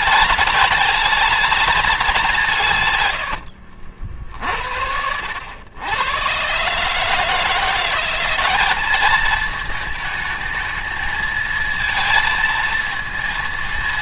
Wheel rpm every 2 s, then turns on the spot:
210, 150, 70, 140, 200, 220, 230.
none